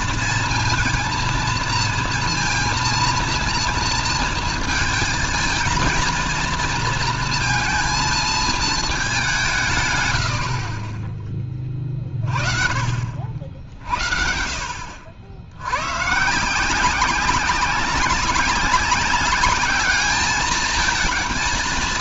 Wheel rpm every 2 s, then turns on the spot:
230, 230, 230, 230, 220, 60, 50, 60, 170, 200, 220.
none